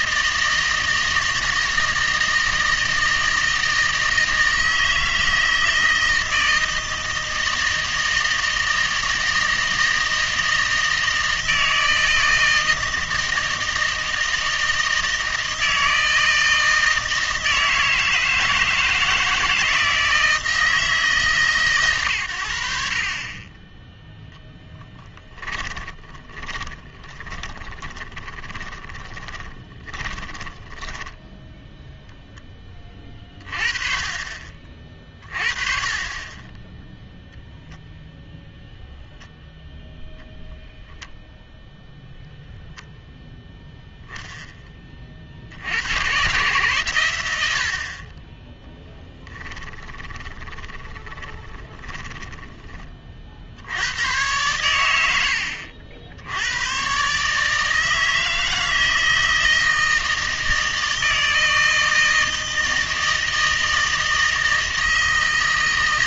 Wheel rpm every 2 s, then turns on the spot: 160, 160, 160, 160, 160, 160, 160, 160, 160, 160, 160, 70, 10, 20, 20, 10, 20, 40, 10, 0, 0, 0, 20, 120, 10, 10, 20, 100, 110, 160, 160, 160, 160.
24-32 50-52